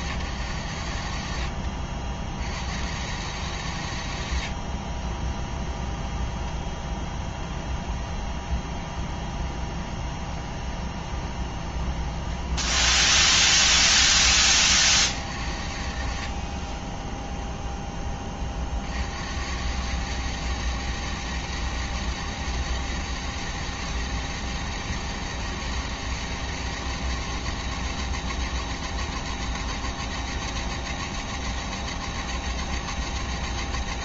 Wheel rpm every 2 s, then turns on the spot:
100, 60, 50, 10, 20, 20, 10, 20, 40, 40, 110, 110, 110, 110, 110, 110, 110.
6-14 16-18